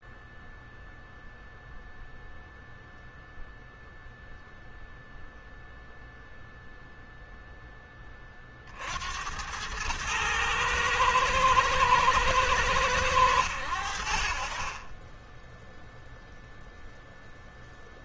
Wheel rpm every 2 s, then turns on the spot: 0, 0, 0, 0, 60, 110, 110, 30, 0.
none